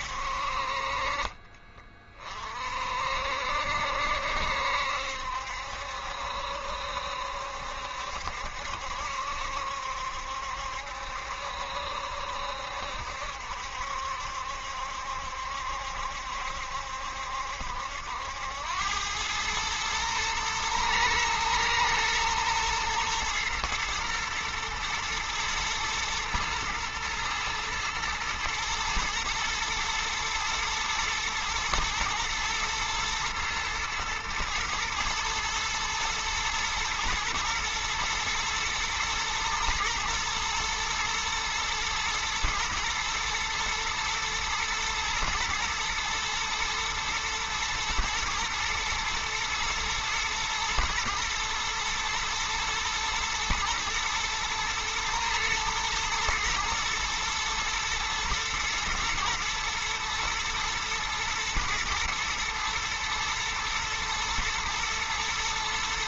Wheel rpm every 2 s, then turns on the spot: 50, 50, 70, 70, 70, 70, 70, 70, 70, 90, 110, 120, 120, 110, 110, 110, 110, 110, 110, 110, 120, 120, 120, 120, 120, 120, 120, 120, 120, 120, 120, 110, 110.
none